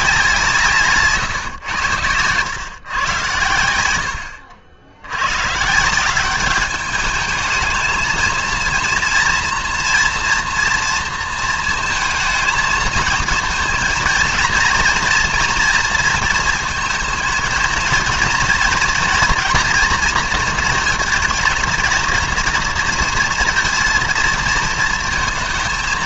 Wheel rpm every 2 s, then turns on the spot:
170, 120, 70, 200, 230, 230, 220, 240, 220, 230, 220, 230, 220.
none